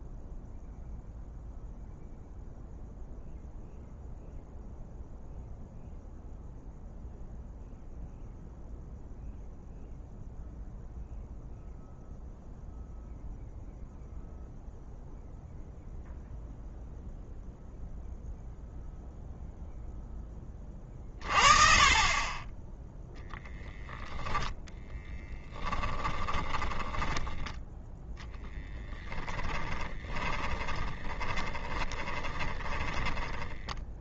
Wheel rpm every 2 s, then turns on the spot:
0, 0, 0, 0, 0, 0, 0, 0, 0, 0, 20, 10, 10, 20, 10, 20, 20.
28-32